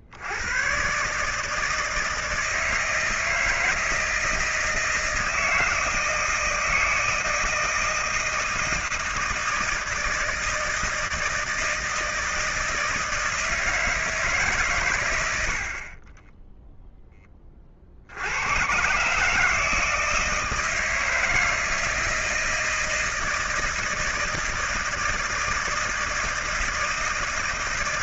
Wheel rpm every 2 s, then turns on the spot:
90, 160, 160, 160, 160, 160, 160, 130, 0, 120, 160, 160, 160, 160.
none